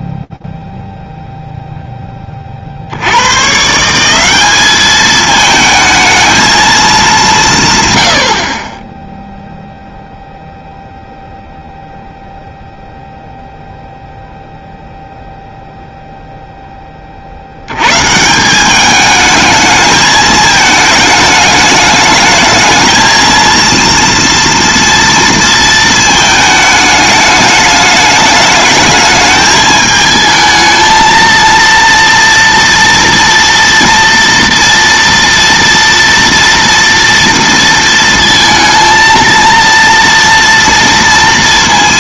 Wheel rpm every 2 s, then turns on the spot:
0, 0, 160, 220, 130, 0, 0, 0, 0, 170, 220, 210, 230, 220, 210, 220, 230, 230, 230, 230, 230.
none